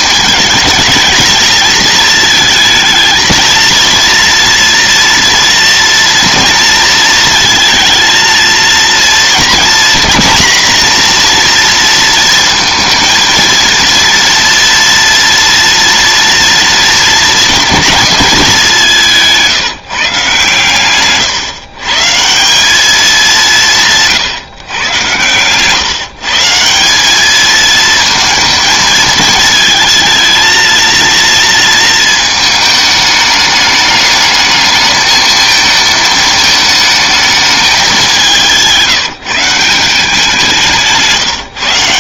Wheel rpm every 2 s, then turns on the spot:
220, 230, 230, 230, 230, 240, 230, 230, 230, 180, 130, 200, 130, 190, 220, 230, 210, 220, 220, 170, 160.
none